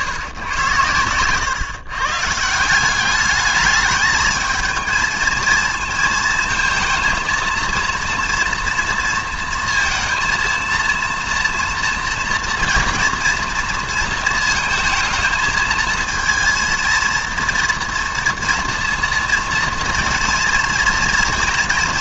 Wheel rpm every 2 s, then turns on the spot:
100, 160, 220, 220, 230, 230, 240, 230, 230, 230, 230.
none